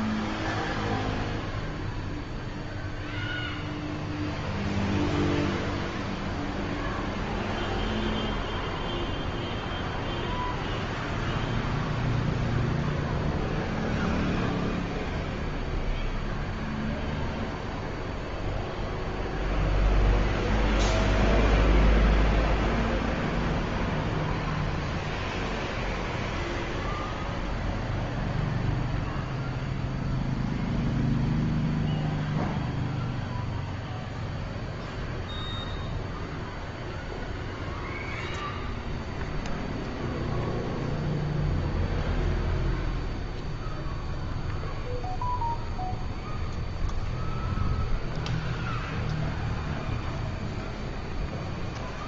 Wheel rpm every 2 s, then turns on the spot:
0, 0, 0, 0, 0, 0, 0, 0, 0, 0, 0, 0, 0, 0, 0, 0, 0, 0, 0, 0, 0, 0, 0, 0, 0, 0.
none